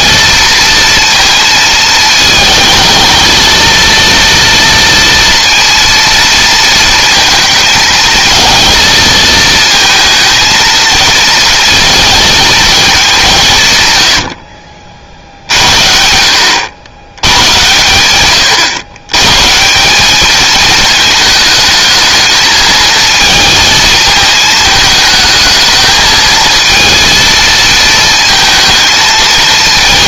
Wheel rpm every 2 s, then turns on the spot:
230, 230, 230, 230, 220, 230, 210, 60, 90, 120, 220, 220, 220, 230, 220.
none